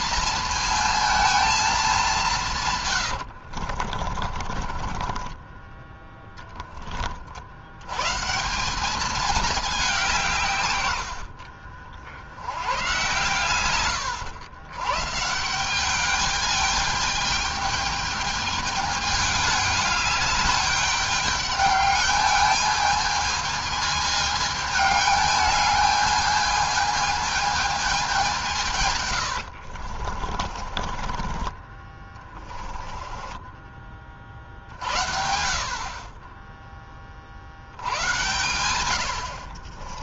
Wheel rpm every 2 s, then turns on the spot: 230, 160, 30, 10, 160, 140, 100, 100, 210, 210, 210, 210, 220, 220, 170, 40, 20, 40, 20, 80.
2-6 30-34